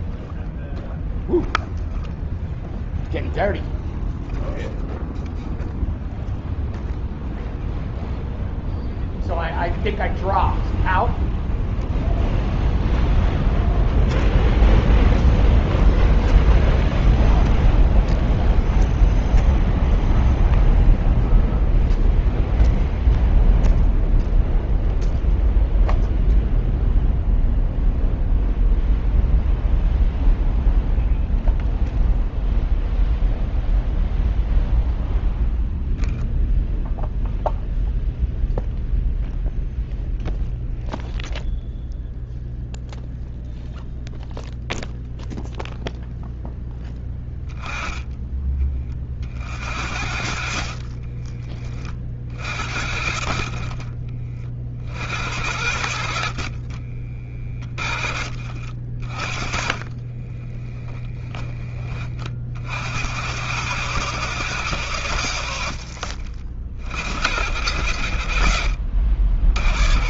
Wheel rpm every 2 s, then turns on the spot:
0, 0, 0, 0, 0, 0, 0, 0, 0, 0, 0, 0, 0, 0, 0, 0, 0, 0, 0, 0, 0, 0, 0, 10, 50, 30, 40, 70, 30, 30, 30, 100, 60, 60, 70.
54-56 58-60